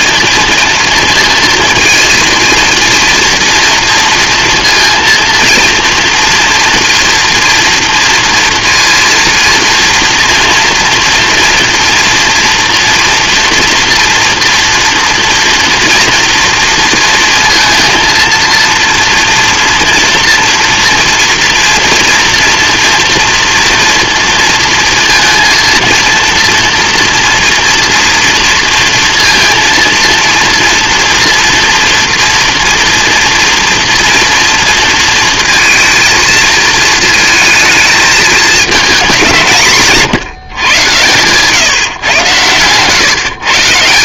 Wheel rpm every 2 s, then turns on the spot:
230, 230, 230, 230, 230, 230, 240, 230, 230, 230, 240, 230, 230, 230, 230, 240, 240, 230, 230, 210, 130, 120.
none